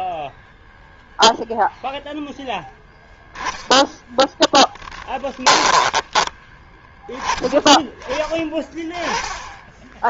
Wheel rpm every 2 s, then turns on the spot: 0, 10, 10, 10, 10.
2-6 8-10